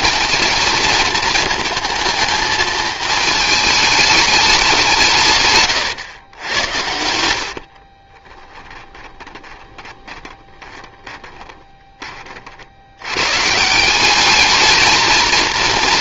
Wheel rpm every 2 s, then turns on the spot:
220, 220, 160, 80, 20, 20, 90, 220.
8-12